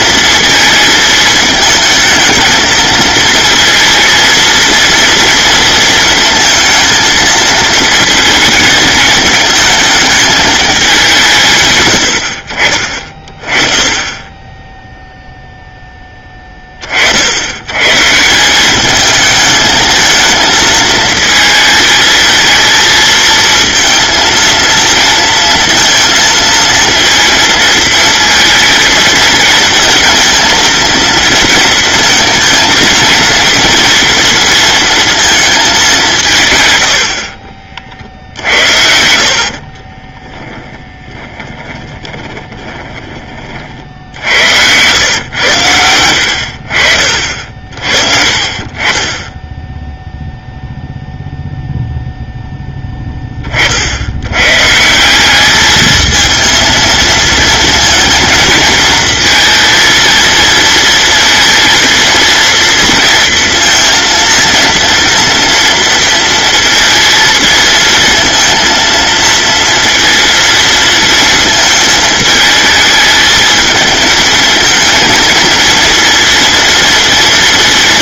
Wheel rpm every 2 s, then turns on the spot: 220, 220, 230, 230, 220, 180, 30, 0, 60, 210, 220, 230, 230, 230, 230, 230, 230, 220, 80, 60, 10, 20, 110, 50, 30, 0, 10, 190, 230, 230, 230, 230, 230, 220, 230, 230, 220, 220, 230.
40-42 46-50